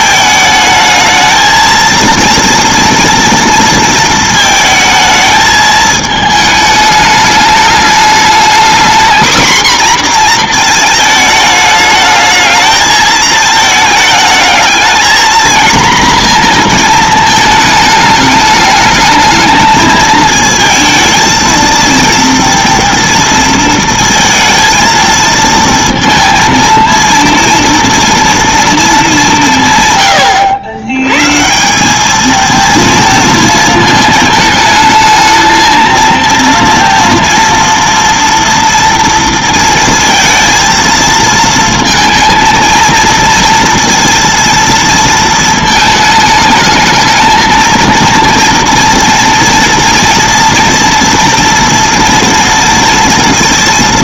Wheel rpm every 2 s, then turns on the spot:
220, 230, 220, 210, 230, 230, 220, 220, 230, 210, 220, 240, 230, 230, 230, 100, 230, 220, 230, 230, 230, 230, 230, 220, 230, 230, 240.
none